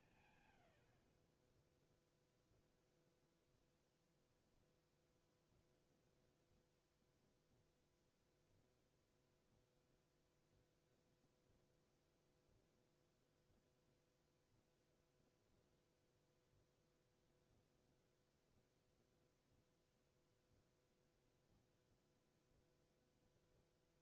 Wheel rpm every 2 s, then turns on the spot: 110, 0, 0, 0, 0, 0, 0, 0, 0, 0, 0, 0.
none